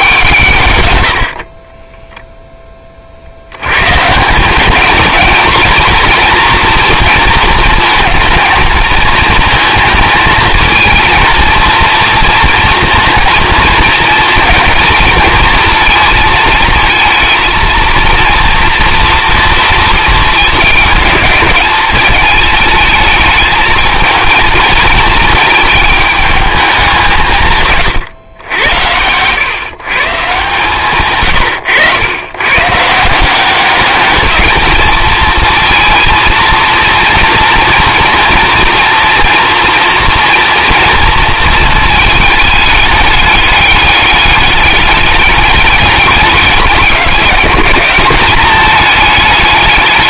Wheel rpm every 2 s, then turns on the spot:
100, 30, 220, 230, 220, 230, 230, 230, 220, 230, 220, 220, 220, 200, 90, 130, 160, 220, 230, 230, 230, 210, 200, 190, 210.
0-2